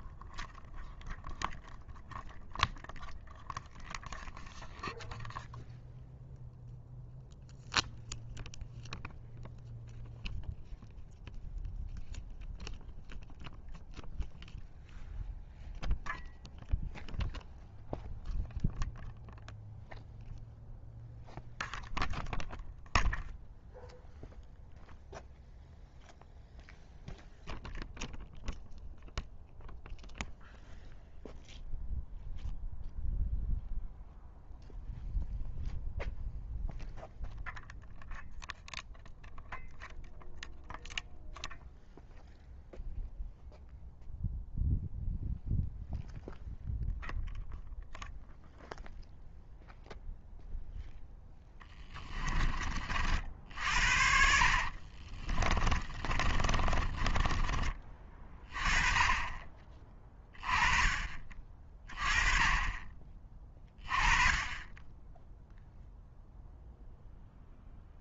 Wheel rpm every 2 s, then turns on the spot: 0, 0, 0, 0, 0, 0, 0, 0, 0, 0, 0, 0, 0, 0, 0, 0, 0, 0, 0, 0, 0, 0, 0, 0, 0, 0, 40, 50, 30, 20, 20, 30, 20, 0.
54-58